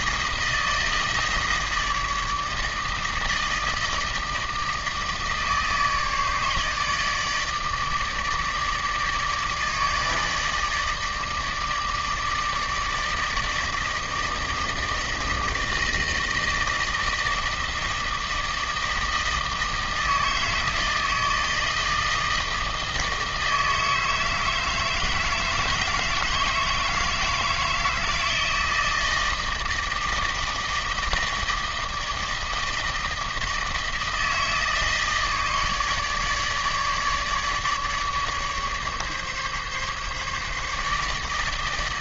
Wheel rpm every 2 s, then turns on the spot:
160, 160, 160, 150, 160, 150, 160, 160, 160, 160, 160, 160, 160, 160, 160, 160, 160, 160, 150, 140, 150.
none